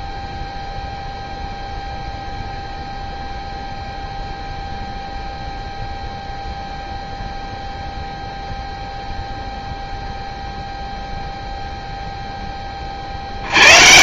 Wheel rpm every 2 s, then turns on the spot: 0, 0, 0, 0, 0, 0, 20.
none